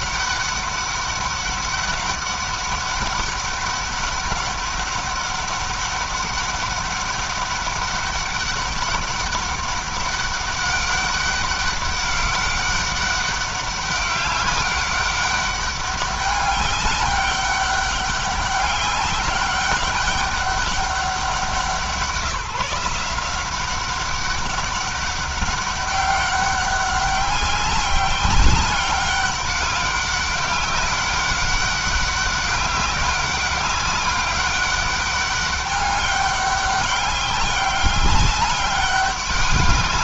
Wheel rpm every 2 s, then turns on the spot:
200, 200, 200, 200, 200, 190, 200, 200, 200, 200, 190, 170, 190, 200, 200, 200, 200, 200, 200, 200.
none